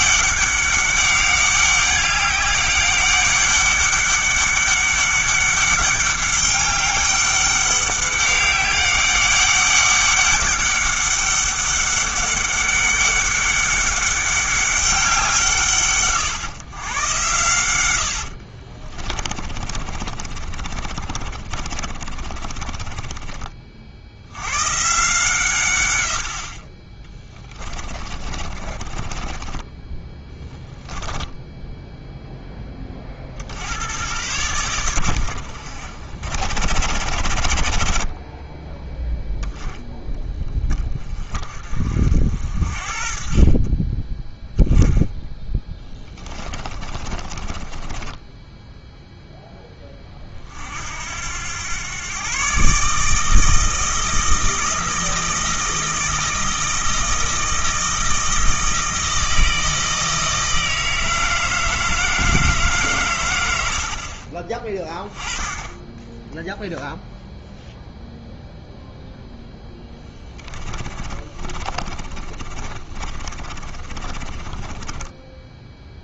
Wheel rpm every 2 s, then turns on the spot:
200, 200, 200, 200, 200, 200, 200, 190, 120, 30, 40, 30, 140, 30, 30, 10, 20, 110, 80, 10, 30, 50, 0, 20, 0, 60, 150, 160, 160, 160, 160, 140, 20, 0, 0, 20, 30, 20.
18-24 28-30 46-48 70-76